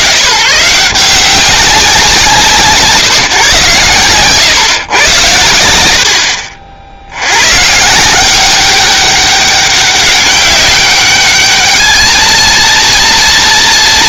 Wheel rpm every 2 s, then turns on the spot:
130, 140, 110, 70, 190, 200, 230.
none